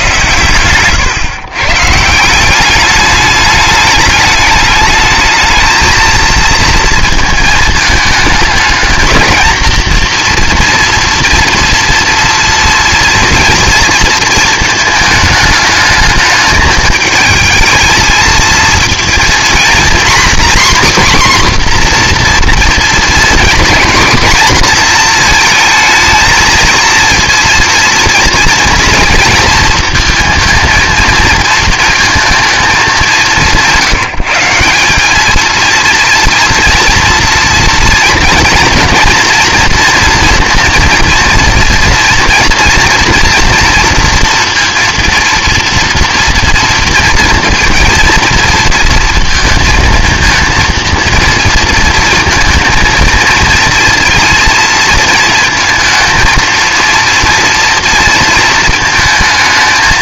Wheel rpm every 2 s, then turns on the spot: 120, 200, 210, 230, 220, 230, 230, 220, 220, 230, 270, 240, 240, 230, 230, 230, 210, 180, 230, 230, 230, 230, 230, 230, 230, 230, 230, 230, 230, 230.
none